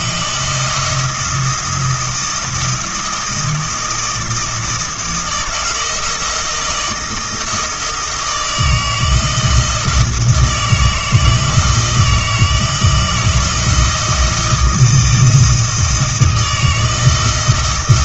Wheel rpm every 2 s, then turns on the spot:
160, 170, 160, 160, 160, 160, 160, 160, 160.
none